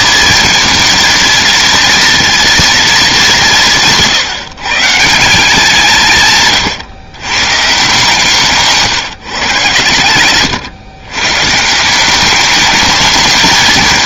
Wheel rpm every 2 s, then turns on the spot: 220, 230, 150, 140, 150, 120, 210.
8-10